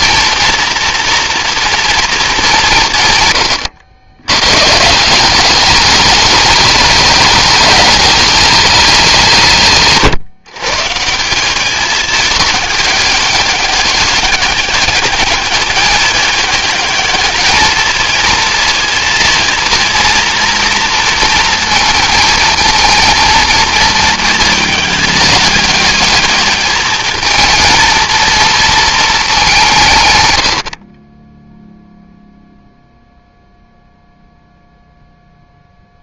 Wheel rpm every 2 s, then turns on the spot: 230, 190, 120, 210, 210, 140, 210, 200, 210, 220, 230, 220, 220, 210, 230, 70, 0, 0.
none